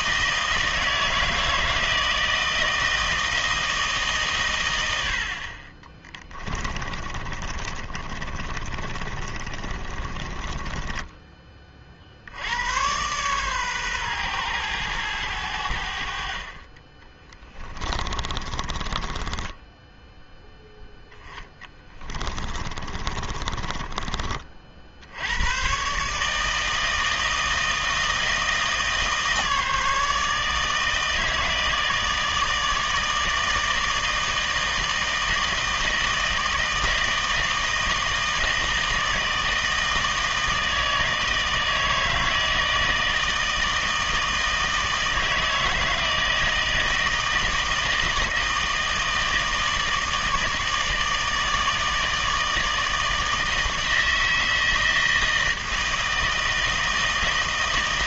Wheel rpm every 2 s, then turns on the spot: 160, 160, 100, 30, 30, 10, 110, 110, 30, 20, 0, 30, 60, 160, 160, 160, 160, 160, 160, 160, 160, 160, 160, 160, 160, 160, 160, 160, 160.
6-12 18-20 22-24